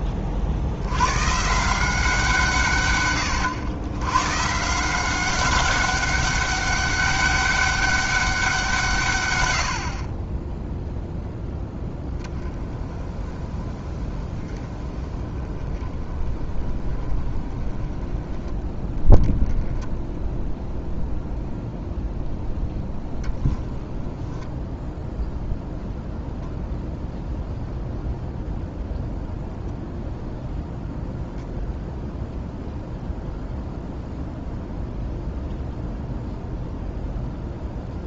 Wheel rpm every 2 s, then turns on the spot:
30, 160, 120, 200, 190, 30, 20, 20, 20, 20, 10, 0, 10, 0, 0, 0, 0, 0, 0.
none